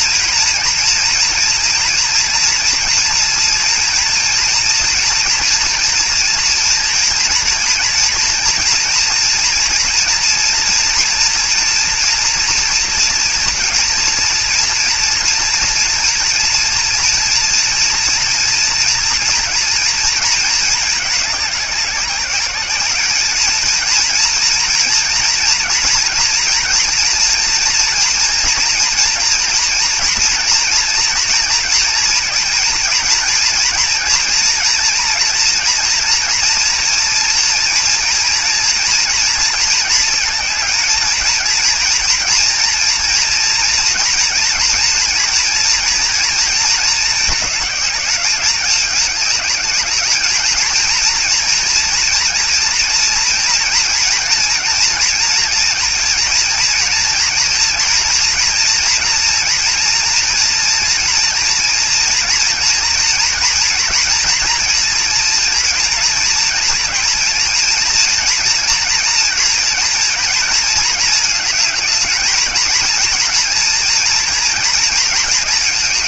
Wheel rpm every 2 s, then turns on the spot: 230, 230, 230, 230, 230, 230, 230, 230, 230, 240, 220, 210, 230, 230, 230, 230, 230, 230, 240, 230, 220, 230, 230, 230, 200, 220, 230, 230, 230, 230, 230, 230, 230, 230, 230, 220, 220, 230.
none